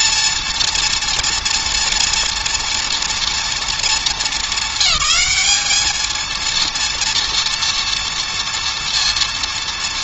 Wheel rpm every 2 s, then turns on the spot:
230, 230, 210, 230, 230.
none